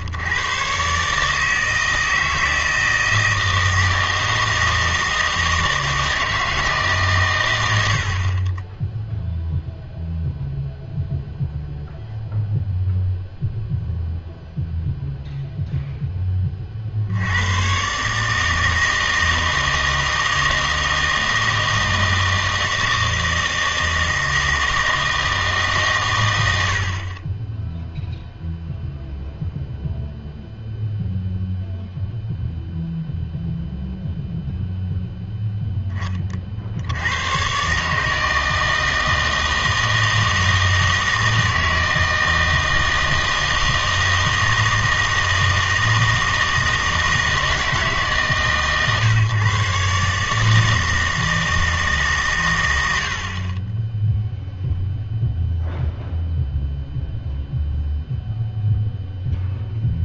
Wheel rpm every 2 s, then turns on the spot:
120, 160, 160, 150, 10, 0, 0, 0, 40, 160, 160, 160, 160, 70, 0, 0, 0, 0, 70, 160, 160, 160, 160, 160, 140, 160, 110, 0, 0, 0.
none